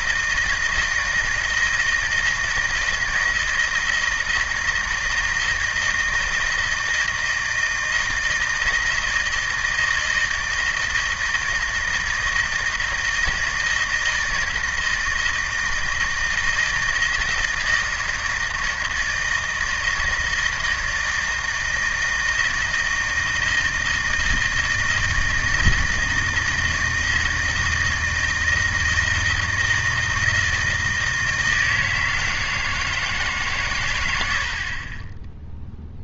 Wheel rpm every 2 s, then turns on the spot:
160, 160, 160, 160, 160, 160, 160, 160, 160, 160, 160, 160, 160, 160, 160, 160, 160, 40.
none